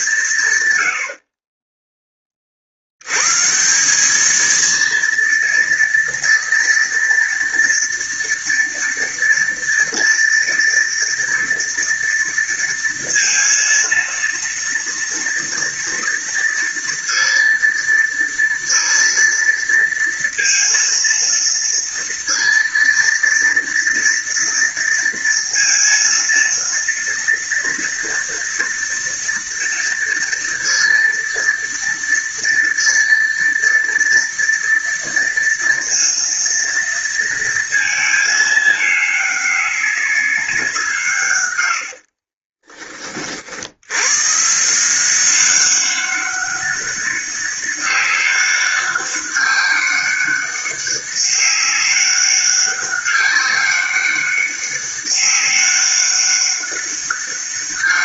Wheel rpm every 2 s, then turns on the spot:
120, 60, 230, 230, 230, 230, 230, 230, 230, 230, 230, 230, 230, 230, 230, 230, 230, 230, 230, 210, 180, 20, 160, 200, 200, 200, 200, 200, 200.
42-44